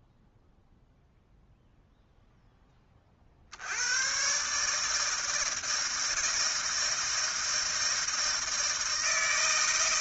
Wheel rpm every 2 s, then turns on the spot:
0, 10, 150, 160, 160.
none